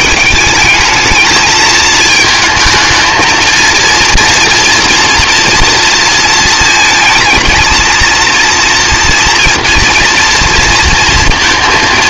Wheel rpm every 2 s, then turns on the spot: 210, 220, 240, 220, 230, 230.
none